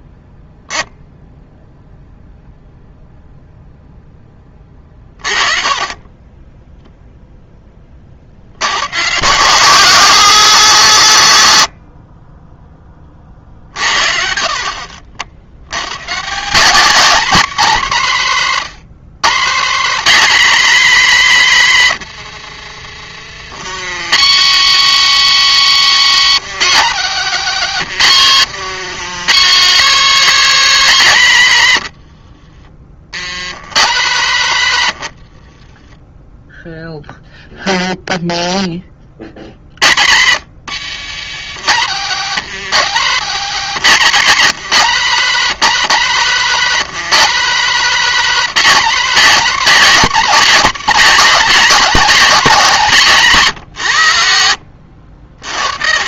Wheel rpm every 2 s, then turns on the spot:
0, 0, 20, 10, 100, 200, 10, 60, 220, 180, 260, 80, 220, 230, 160, 280, 50, 140, 0, 10, 190, 200, 210, 210, 230, 230, 210, 80.
22-24 34-36